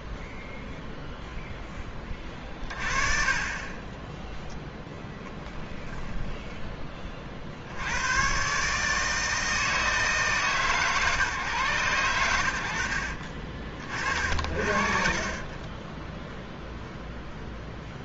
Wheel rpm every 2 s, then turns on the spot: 0, 20, 10, 10, 140, 150, 80, 50, 0.
12-16